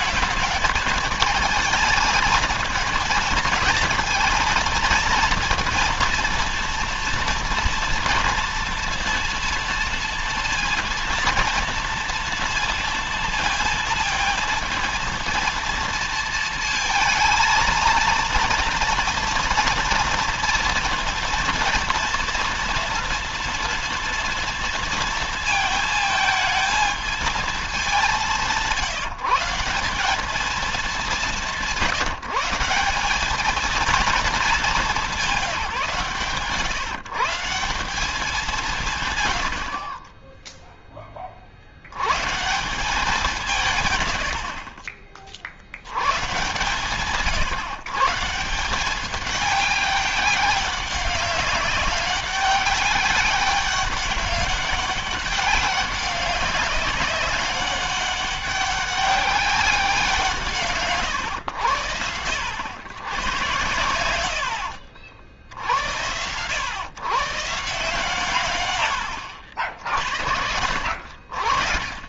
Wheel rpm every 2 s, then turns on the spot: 220, 220, 230, 230, 230, 230, 230, 230, 230, 230, 230, 230, 230, 220, 170, 210, 180, 210, 150, 170, 20, 180, 50, 140, 190, 200, 200, 200, 190, 200, 130, 90, 60, 130, 100, 60.
none